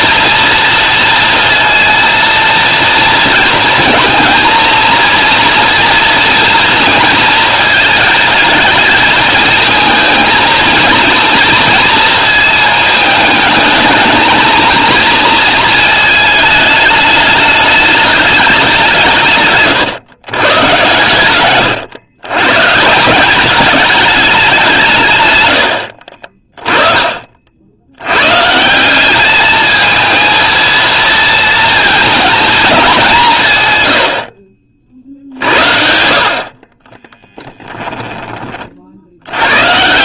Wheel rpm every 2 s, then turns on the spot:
230, 230, 230, 230, 220, 230, 220, 230, 210, 180, 120, 160, 170, 30, 190, 230, 200, 50, 30, 50.
26-28 36-38